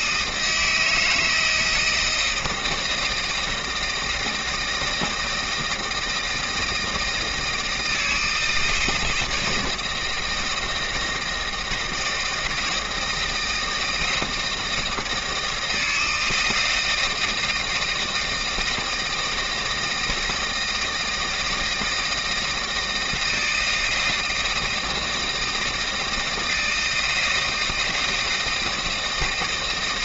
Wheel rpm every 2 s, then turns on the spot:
160, 160, 160, 160, 160, 160, 160, 160, 160, 160, 160, 160, 160, 170, 160.
none